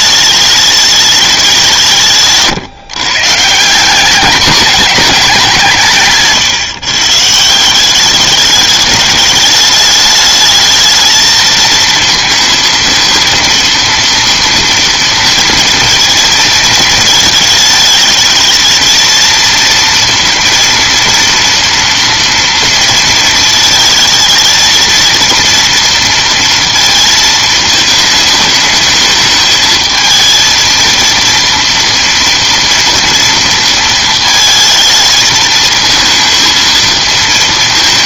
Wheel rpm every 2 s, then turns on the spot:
210, 130, 210, 140, 210, 220, 230, 230, 230, 220, 230, 230, 230, 230, 220, 230, 230, 220, 230.
none